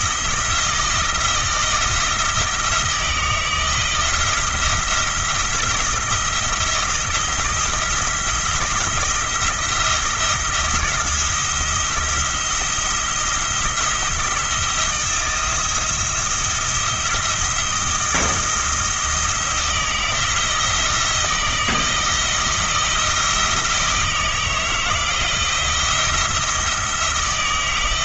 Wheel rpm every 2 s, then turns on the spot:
160, 160, 170, 170, 170, 170, 170, 170, 170, 170, 160, 160, 160, 170.
none